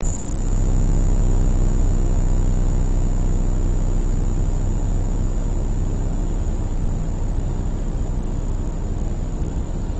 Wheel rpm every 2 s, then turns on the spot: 0, 0, 0, 0, 0.
none